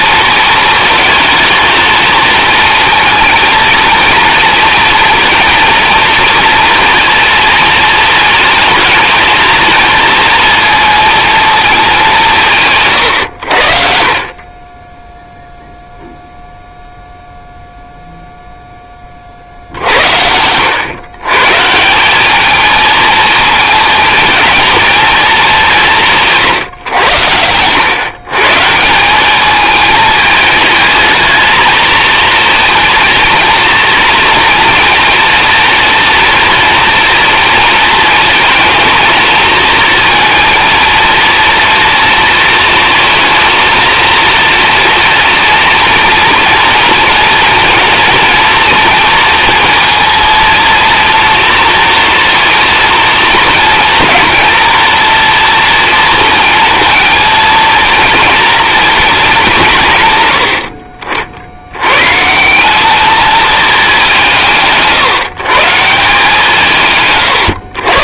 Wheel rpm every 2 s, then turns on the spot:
220, 230, 230, 230, 220, 220, 140, 20, 0, 0, 100, 220, 220, 120, 150, 220, 230, 230, 230, 220, 230, 230, 230, 230, 230, 230, 230, 230, 230, 230, 60, 200, 150, 160.
60-62